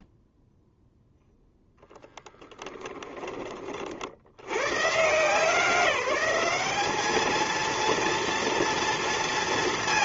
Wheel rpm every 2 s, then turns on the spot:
0, 10, 100, 200, 230.
2-4